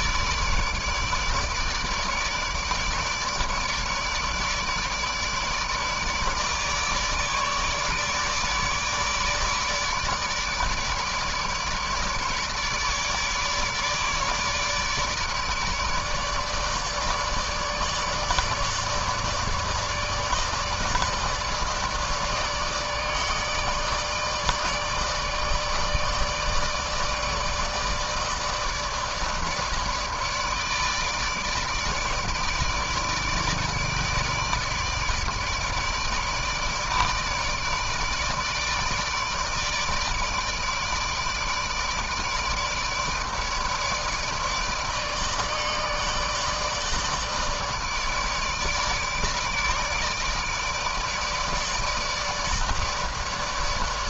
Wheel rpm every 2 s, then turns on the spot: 150, 150, 150, 150, 150, 150, 150, 150, 150, 150, 150, 150, 150, 150, 150, 150, 160, 160, 150, 160, 160, 160, 150, 150, 150, 150, 150.
none